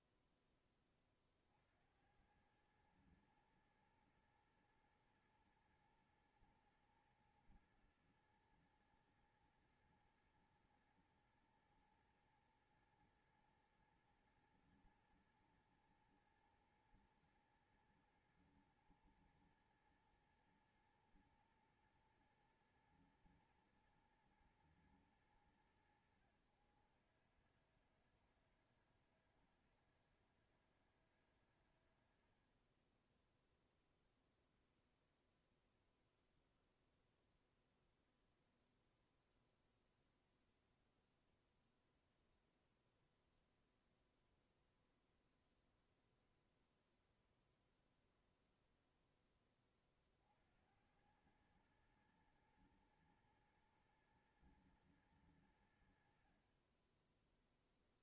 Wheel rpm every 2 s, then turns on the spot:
0, 90, 120, 120, 110, 120, 120, 110, 110, 120, 120, 120, 120, 90, 80, 90, 50, 0, 0, 0, 0, 0, 0, 0, 0, 50, 110, 110, 60.
none